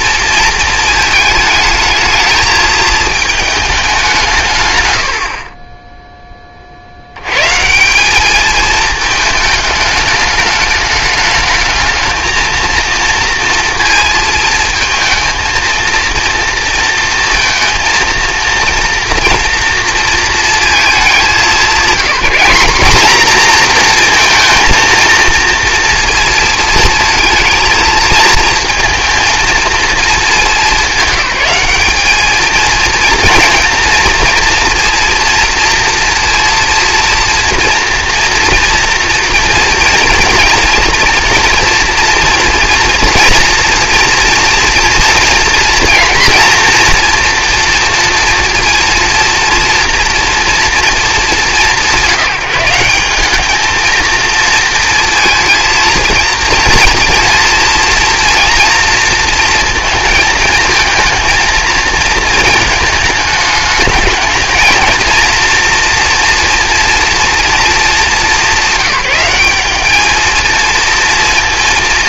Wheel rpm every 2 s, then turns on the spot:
230, 220, 100, 70, 220, 220, 230, 220, 230, 230, 210, 210, 230, 230, 220, 200, 220, 230, 230, 240, 230, 230, 230, 240, 230, 230, 180, 230, 230, 240, 220, 220, 220, 240, 190, 230.
none